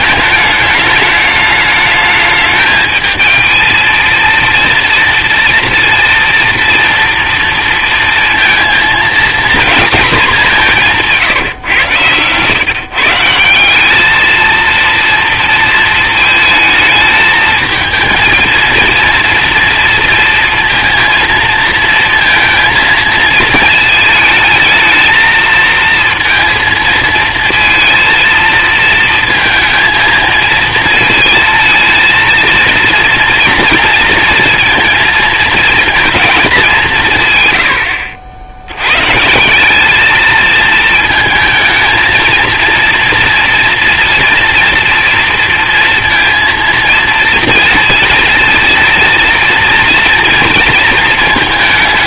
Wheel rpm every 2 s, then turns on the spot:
210, 220, 230, 230, 230, 190, 130, 220, 220, 230, 230, 230, 220, 230, 220, 220, 230, 230, 200, 100, 220, 230, 230, 230, 230, 230.
none